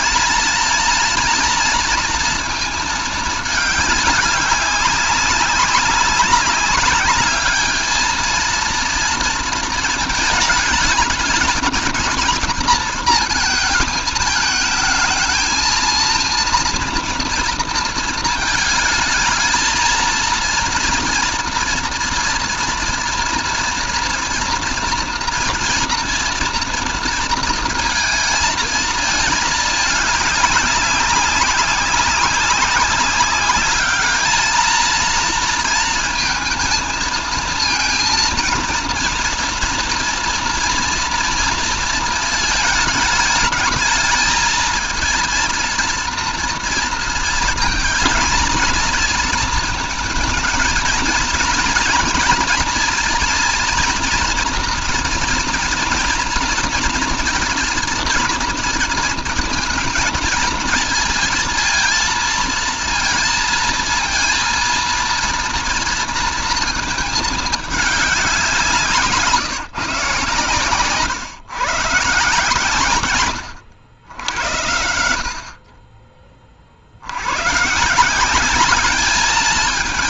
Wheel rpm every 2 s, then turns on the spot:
230, 220, 200, 200, 230, 210, 220, 220, 240, 220, 230, 230, 230, 230, 220, 200, 190, 220, 220, 230, 230, 220, 220, 230, 230, 220, 240, 240, 230, 230, 220, 230, 230, 220, 160, 130, 130, 80, 40, 210.
none